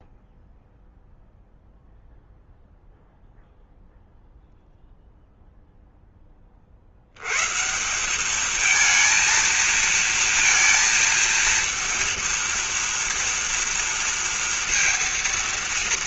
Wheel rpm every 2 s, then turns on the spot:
0, 0, 0, 70, 220, 230, 230, 230.
none